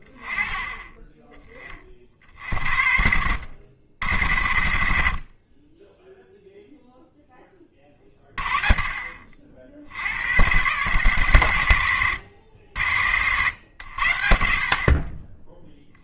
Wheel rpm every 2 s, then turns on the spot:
20, 60, 50, 0, 30, 110, 80, 50.
none